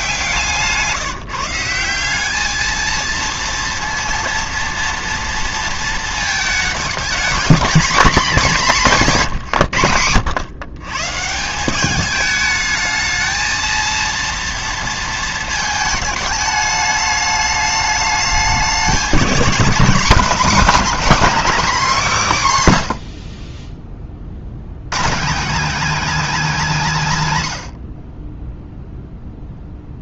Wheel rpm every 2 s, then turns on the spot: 160, 220, 230, 210, 200, 130, 220, 230, 210, 210, 270, 160, 120, 250, 0.
none